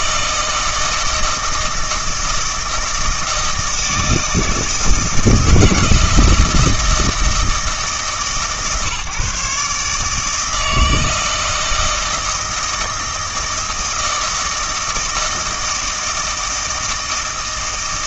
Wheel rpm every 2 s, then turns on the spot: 160, 160, 160, 160, 150, 160, 160, 160, 160.
none